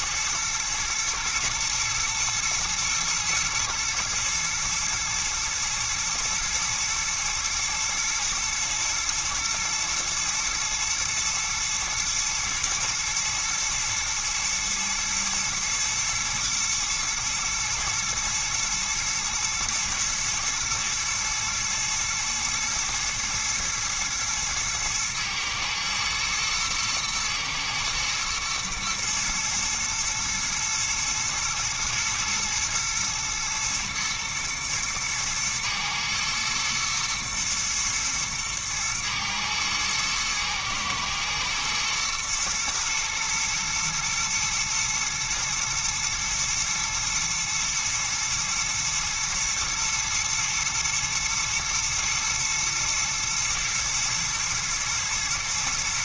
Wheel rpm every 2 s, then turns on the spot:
120, 120, 110, 110, 120, 120, 110, 110, 110, 110, 110, 120, 110, 110, 120, 110, 120, 120, 120, 110, 110, 110, 110, 110, 110, 120, 120, 120.
none